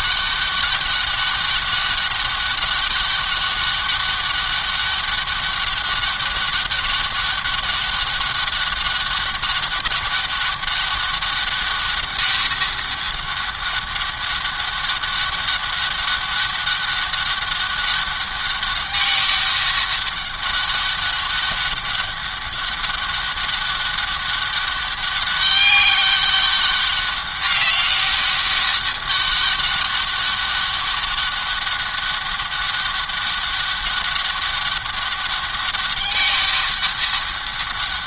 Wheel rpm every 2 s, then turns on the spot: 200, 200, 200, 200, 200, 200, 200, 200, 200, 200, 200, 200, 200, 200, 200, 200, 200, 200, 200.
none